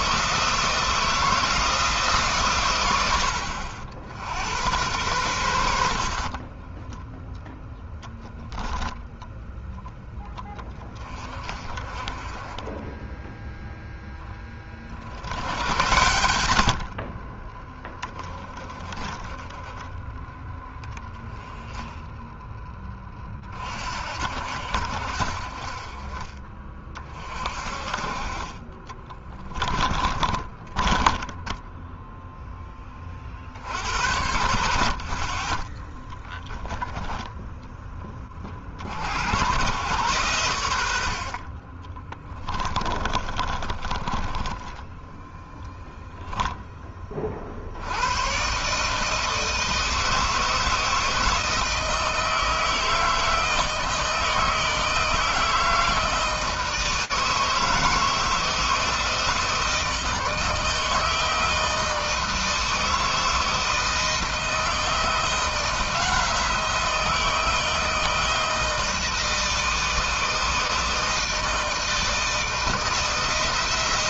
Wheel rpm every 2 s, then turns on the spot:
170, 100, 90, 10, 0, 20, 10, 40, 50, 20, 10, 20, 70, 30, 20, 20, 30, 50, 10, 70, 70, 30, 10, 20, 150, 160, 160, 160, 160, 160, 160, 160, 160, 160, 160, 160, 160.
16-20 28-32 40-46